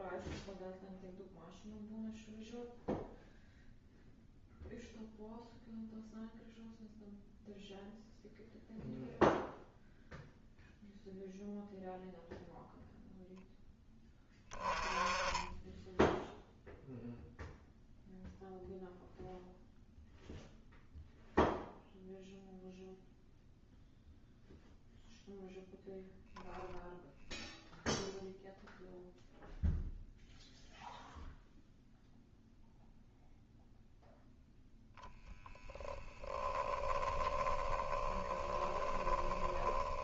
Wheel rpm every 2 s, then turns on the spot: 0, 0, 0, 0, 0, 0, 0, 10, 0, 0, 0, 0, 0, 0, 0, 0, 0, 0, 10, 10.
36-40